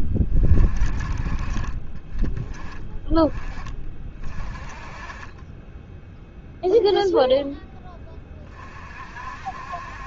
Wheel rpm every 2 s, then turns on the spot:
20, 20, 20, 0, 40.
none